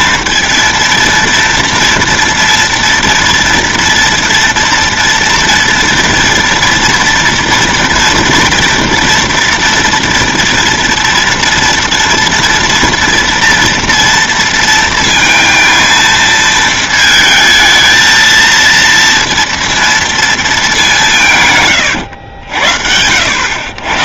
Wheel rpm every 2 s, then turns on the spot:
230, 230, 230, 230, 230, 230, 230, 230, 220, 230, 200, 80.
none